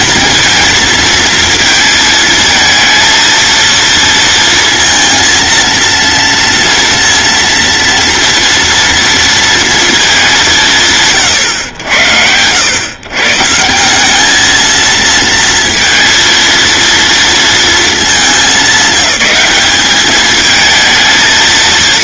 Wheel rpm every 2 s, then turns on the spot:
230, 230, 230, 230, 230, 160, 110, 220, 230, 200, 220.
none